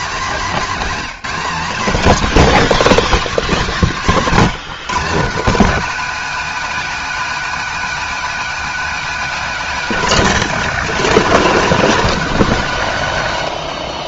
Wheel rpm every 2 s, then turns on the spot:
190, 240, 160, 270, 270, 250, 240.
none